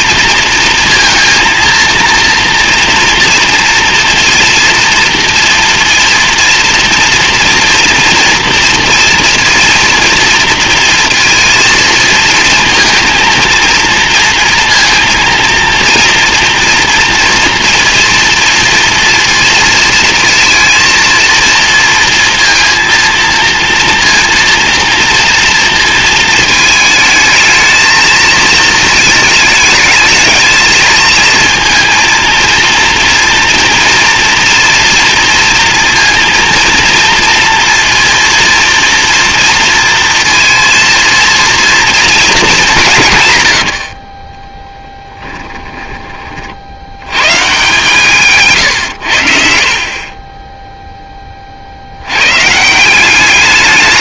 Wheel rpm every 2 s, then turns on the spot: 230, 230, 230, 230, 230, 230, 230, 230, 230, 230, 230, 230, 230, 220, 220, 220, 230, 240, 230, 230, 230, 210, 20, 60, 140, 20, 140.
44-46